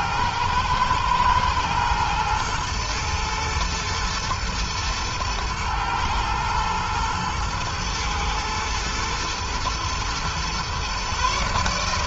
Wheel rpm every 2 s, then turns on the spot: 110, 110, 120, 120, 110, 130.
none